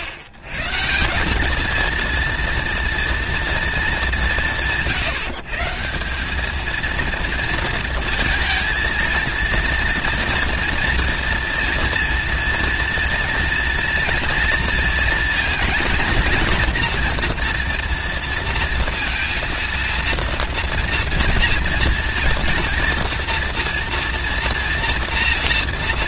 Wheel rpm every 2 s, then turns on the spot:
110, 230, 130, 230, 220, 240, 230, 230, 230, 230, 230, 240, 230.
none